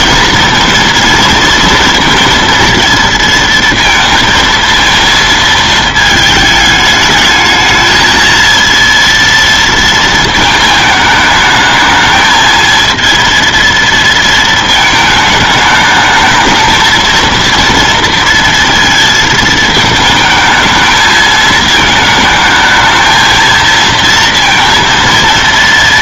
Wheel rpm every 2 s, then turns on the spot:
230, 230, 230, 220, 230, 220, 220, 220, 220, 230, 220, 220, 230.
none